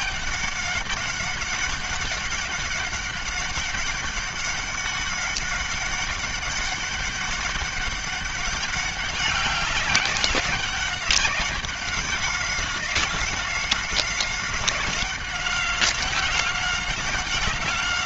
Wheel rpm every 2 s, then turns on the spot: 200, 200, 200, 200, 200, 200, 190, 190, 190.
none